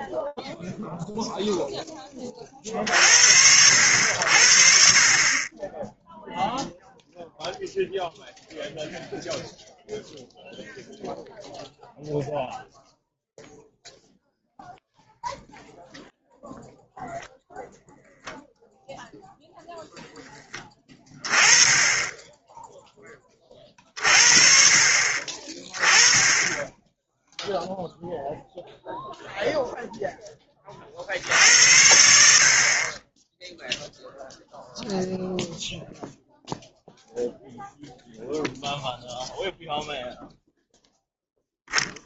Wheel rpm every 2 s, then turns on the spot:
20, 70, 0, 0, 0, 0, 0, 0, 0, 0, 10, 40, 20, 0, 10, 60, 0, 0, 0, 0, 0.
none